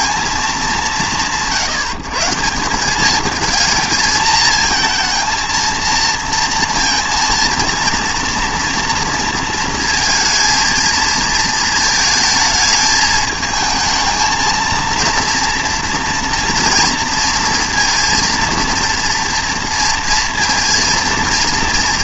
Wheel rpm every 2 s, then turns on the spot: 170, 190, 220, 230, 230, 230, 220, 220, 230, 230, 230.
none